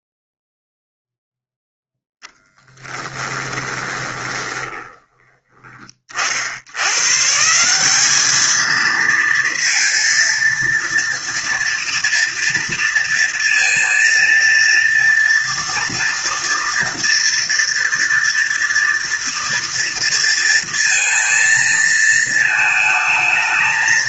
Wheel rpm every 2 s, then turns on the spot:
0, 10, 20, 130, 230, 230, 230, 230, 230, 230, 230, 220.
2-4